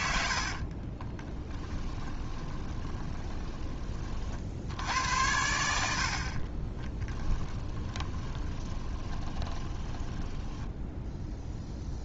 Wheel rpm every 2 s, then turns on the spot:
30, 20, 80, 20, 20, 10.
0-4 6-10